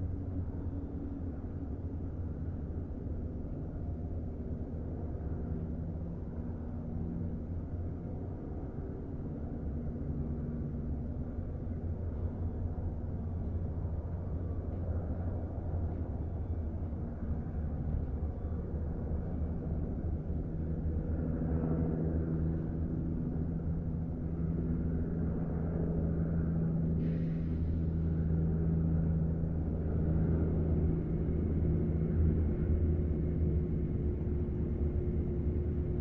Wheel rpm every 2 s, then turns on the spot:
0, 0, 0, 0, 0, 0, 0, 0, 0, 0, 0, 0, 0, 0, 0, 0, 0, 0.
none